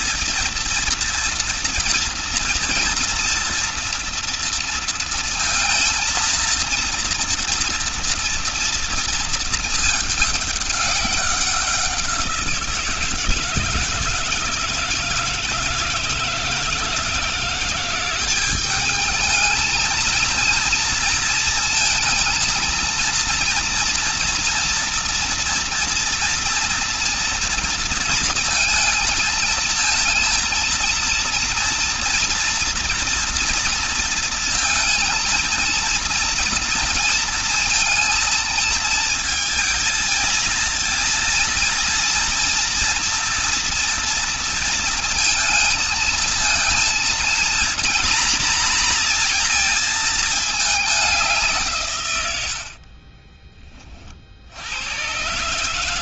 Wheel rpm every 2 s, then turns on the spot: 230, 230, 230, 230, 220, 190, 150, 160, 170, 210, 230, 230, 230, 230, 230, 230, 230, 230, 230, 220, 230, 230, 230, 230, 240, 200, 50, 90.
52-54